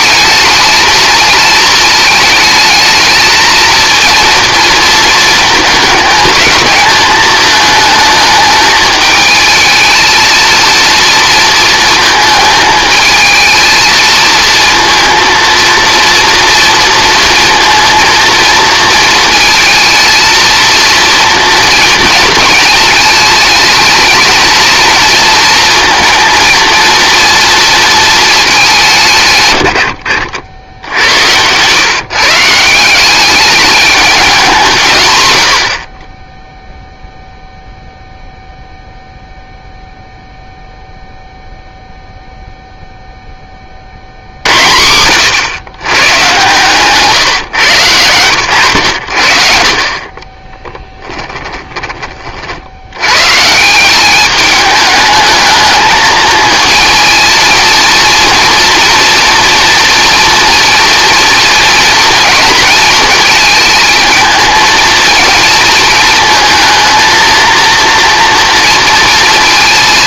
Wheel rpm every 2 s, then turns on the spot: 220, 220, 230, 220, 220, 230, 220, 230, 230, 230, 230, 220, 220, 230, 170, 90, 170, 140, 0, 0, 0, 0, 100, 140, 90, 10, 80, 210, 230, 240, 230, 230, 220, 230, 230.
30-32 50-52